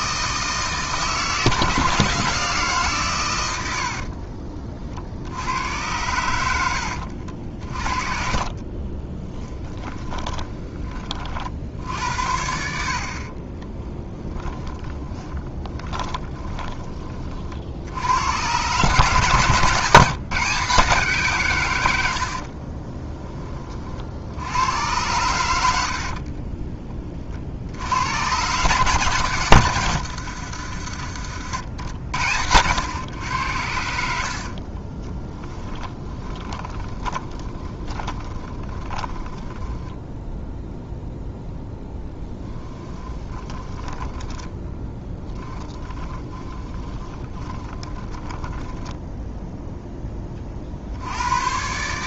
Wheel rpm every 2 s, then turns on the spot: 150, 150, 50, 80, 30, 20, 70, 20, 20, 110, 150, 30, 100, 30, 140, 80, 100, 30, 20, 20, 0, 10, 10, 20, 10, 50.
8-10 14-16 22-24 34-40 42-50